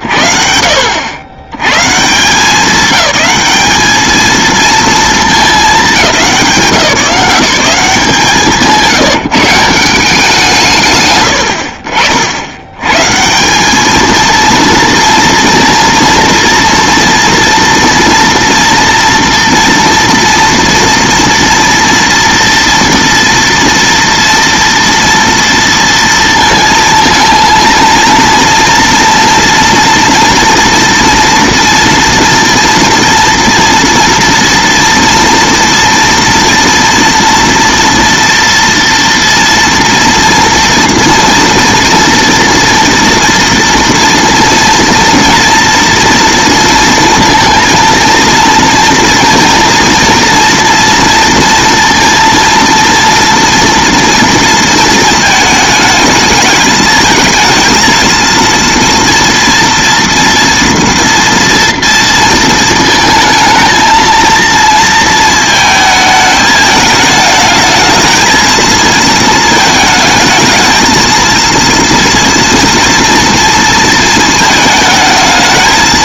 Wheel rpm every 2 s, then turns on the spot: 90, 200, 210, 180, 170, 70, 200, 230, 230, 230, 230, 230, 230, 230, 230, 240, 230, 230, 230, 230, 230, 240, 230, 230, 230, 230, 230, 220, 220, 230, 240, 230, 220, 220, 220, 230, 230, 220.
none